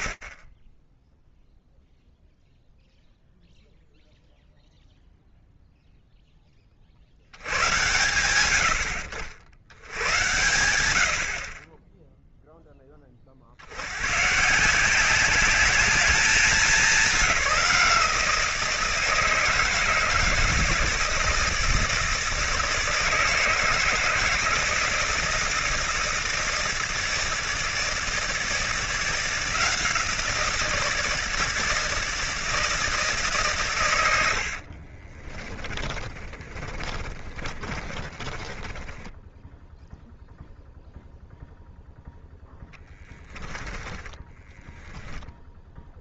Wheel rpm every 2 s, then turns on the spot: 30, 0, 0, 10, 70, 100, 10, 120, 200, 170, 160, 160, 160, 160, 170, 170, 160, 70, 30, 10, 0, 0, 10.
34-40 44-46